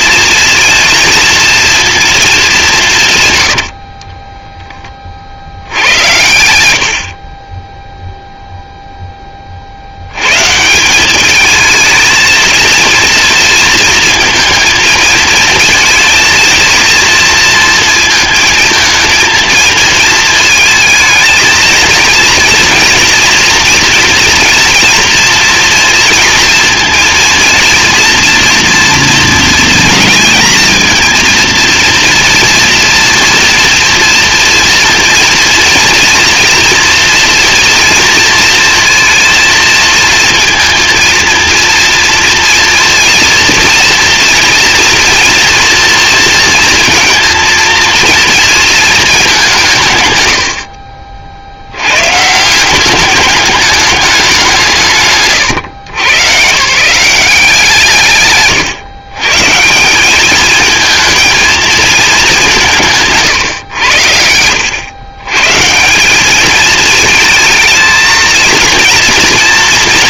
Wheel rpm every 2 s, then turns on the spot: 230, 190, 10, 70, 0, 180, 240, 230, 230, 220, 220, 230, 230, 230, 230, 230, 230, 230, 240, 230, 230, 230, 230, 230, 220, 50, 190, 200, 160, 140, 220, 150, 110, 220, 230.
none